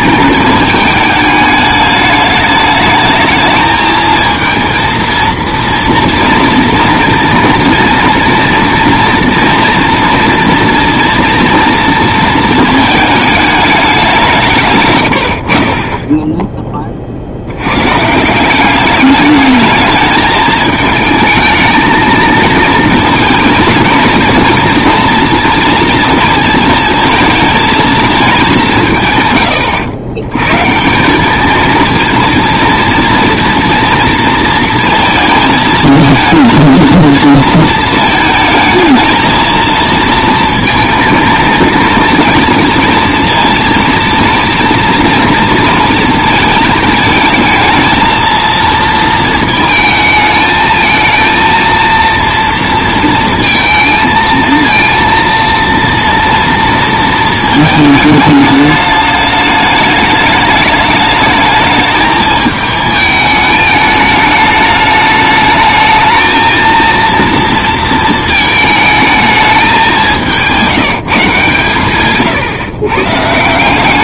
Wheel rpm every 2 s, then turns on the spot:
220, 210, 220, 230, 230, 230, 220, 160, 20, 180, 220, 230, 230, 230, 190, 130, 230, 230, 230, 220, 230, 230, 230, 220, 230, 220, 230, 230, 230, 210, 210, 220, 210, 220, 220, 170, 140.
none